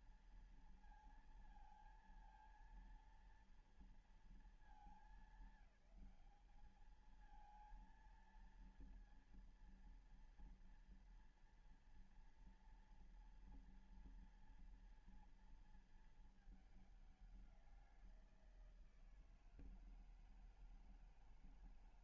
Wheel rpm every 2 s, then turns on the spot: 230, 230, 220, 190, 230, 230, 240, 230, 220, 170, 160.
none